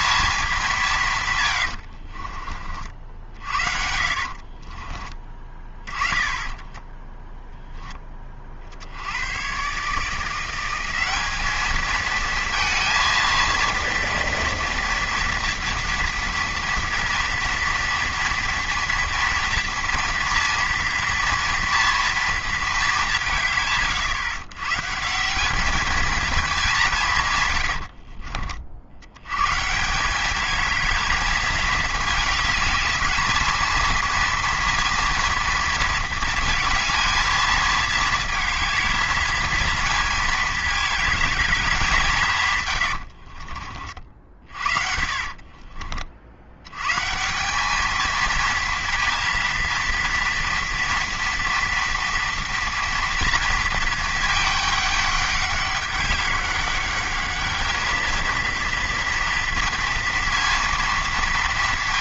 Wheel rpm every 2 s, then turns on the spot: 200, 50, 30, 20, 40, 180, 230, 230, 230, 230, 230, 220, 140, 200, 50, 220, 210, 230, 230, 230, 220, 130, 50, 100, 230, 230, 230, 210, 200, 230, 230.
4-8 44-46